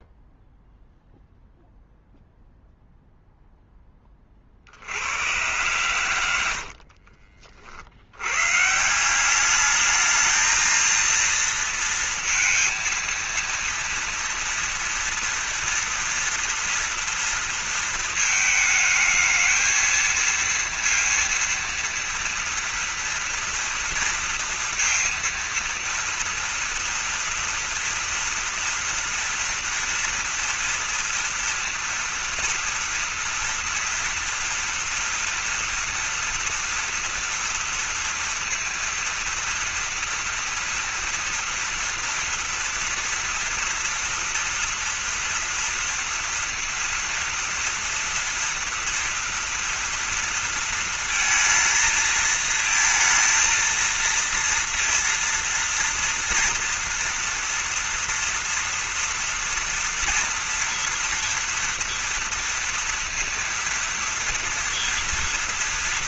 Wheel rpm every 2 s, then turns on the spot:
0, 0, 60, 70, 140, 220, 230, 230, 230, 220, 230, 230, 230, 230, 230, 230, 230, 230, 240, 230, 230, 240, 230, 230, 230, 230, 230, 230, 230, 230, 230, 230, 230.
6-8